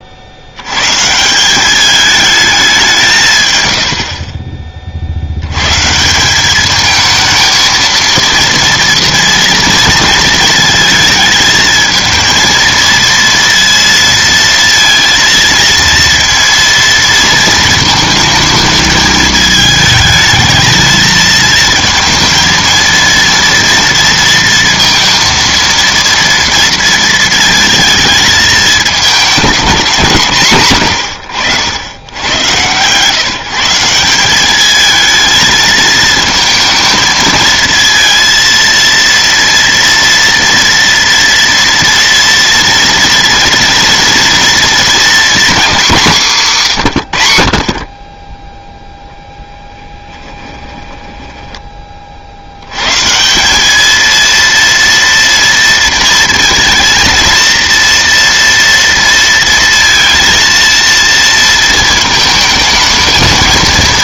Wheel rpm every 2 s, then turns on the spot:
110, 190, 30, 210, 230, 230, 230, 230, 230, 220, 220, 230, 230, 230, 210, 130, 120, 210, 220, 230, 230, 230, 240, 150, 10, 20, 110, 230, 230, 230, 230, 220.
50-52